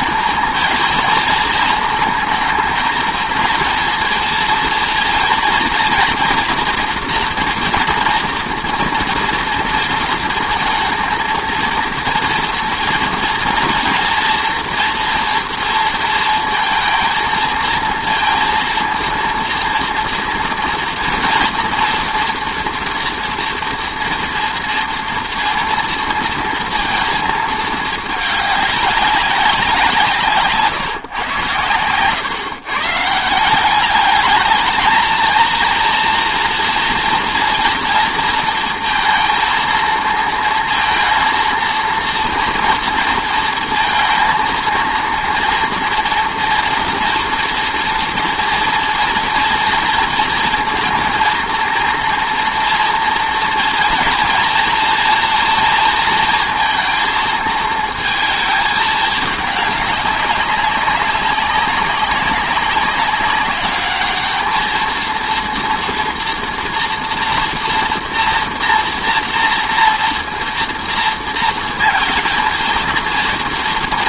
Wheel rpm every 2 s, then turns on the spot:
230, 220, 230, 240, 230, 220, 230, 230, 230, 230, 230, 230, 230, 230, 200, 150, 140, 220, 230, 230, 230, 240, 230, 230, 240, 230, 230, 230, 230, 220, 190, 190, 220, 230, 230, 230, 230.
none